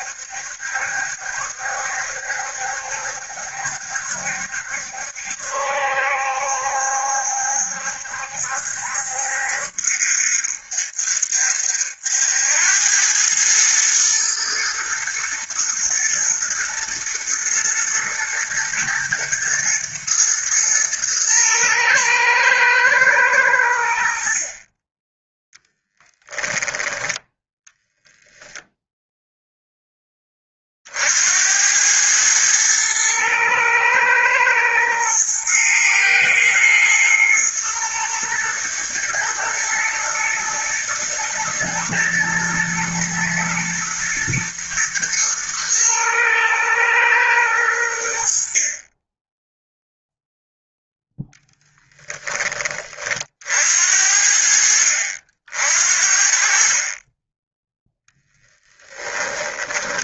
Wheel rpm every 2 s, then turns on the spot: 70, 70, 70, 70, 70, 70, 100, 120, 120, 120, 110, 110, 20, 10, 0, 60, 110, 110, 120, 120, 120, 120, 120, 110, 20, 0, 30, 70, 30, 10.
24-26 58-60